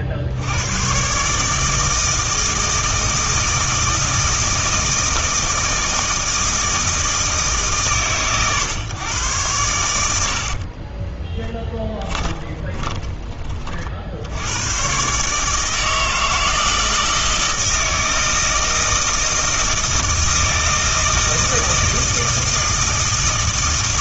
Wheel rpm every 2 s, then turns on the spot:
100, 160, 160, 160, 130, 30, 10, 110, 160, 160, 160, 160.
10-14